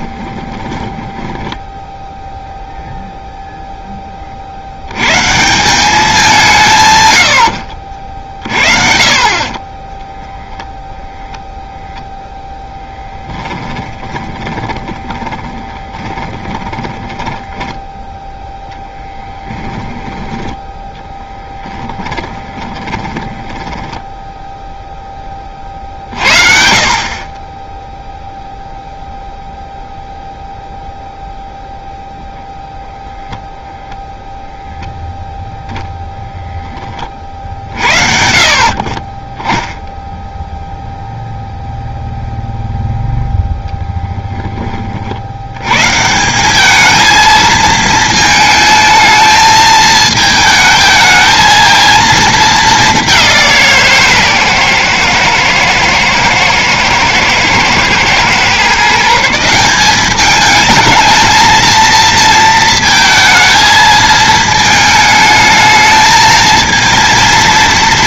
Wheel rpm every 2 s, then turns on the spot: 10, 0, 70, 130, 50, 0, 10, 20, 10, 0, 10, 20, 10, 40, 0, 0, 0, 0, 20, 30, 0, 0, 30, 210, 220, 220, 210, 120, 110, 140, 220, 230, 220, 230.
0-2 12-18 22-24